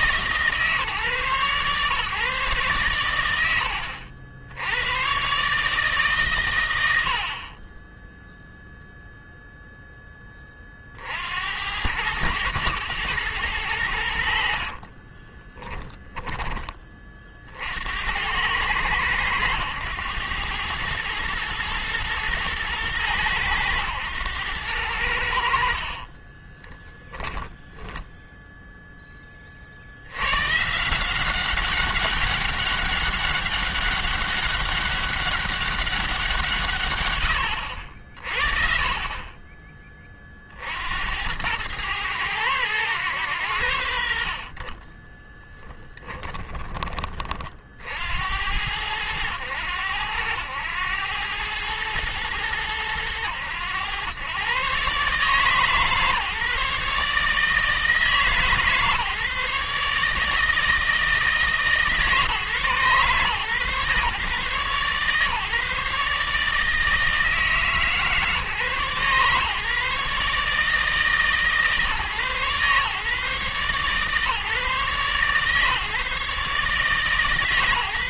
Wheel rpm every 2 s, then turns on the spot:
140, 120, 90, 100, 0, 40, 110, 50, 20, 90, 100, 110, 90, 10, 10, 150, 200, 200, 140, 40, 70, 110, 30, 20, 90, 100, 100, 130, 150, 150, 160, 130, 140, 150, 120, 140, 130, 140, 150.
14-16 26-28